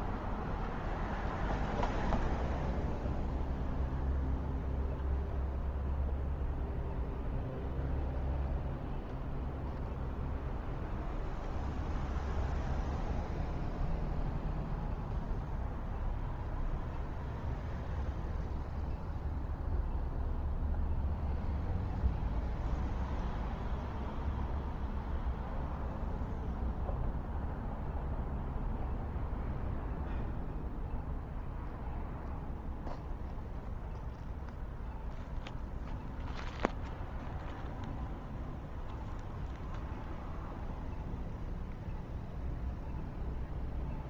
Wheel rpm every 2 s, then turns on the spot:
0, 0, 0, 0, 0, 0, 0, 0, 0, 0, 0, 0, 0, 0, 0, 0, 0, 0, 0, 0, 0, 0.
none